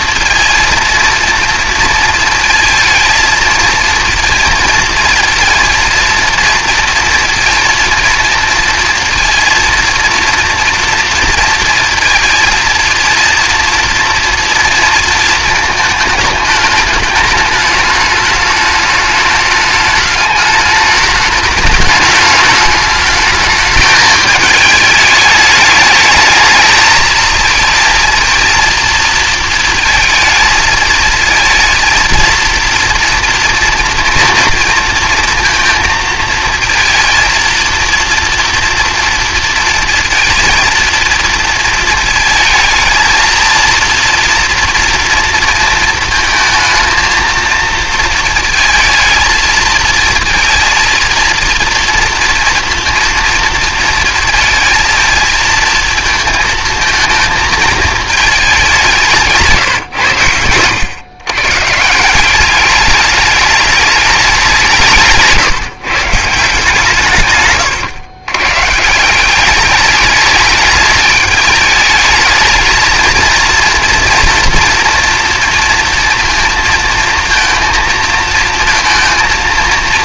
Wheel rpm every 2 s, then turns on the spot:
230, 220, 230, 230, 230, 230, 230, 230, 210, 210, 210, 210, 220, 220, 230, 220, 230, 230, 230, 230, 230, 220, 230, 220, 220, 230, 230, 220, 220, 180, 120, 210, 160, 160, 160, 210, 220, 230, 230, 230.
none